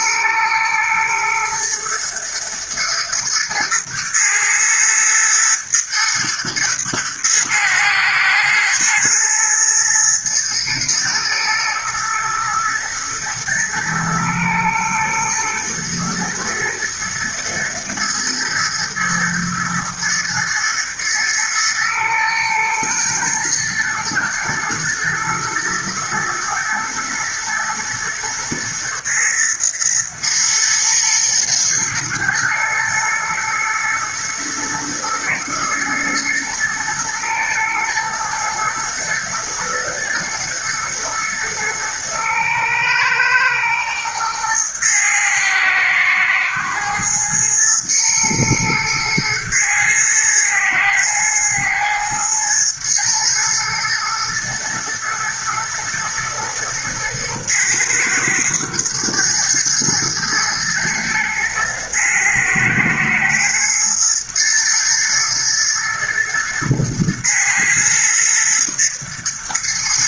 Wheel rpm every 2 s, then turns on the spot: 110, 110, 110, 110, 120, 110, 120, 110, 110, 110, 110, 120, 110, 120, 110, 120, 110, 120, 110, 110, 120, 110, 110, 120, 110, 110, 110, 120, 110, 110, 110, 110, 120, 120, 110.
none